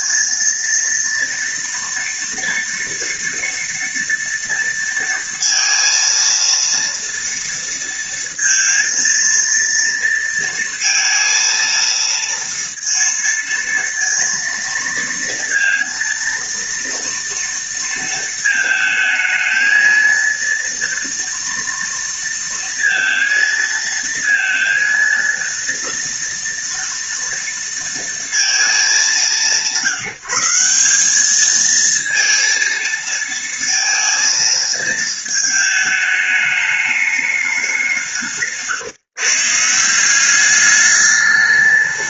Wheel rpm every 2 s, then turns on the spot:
230, 240, 230, 230, 230, 230, 230, 230, 230, 220, 230, 230, 230, 230, 200, 190, 230, 220, 210, 140, 190.
none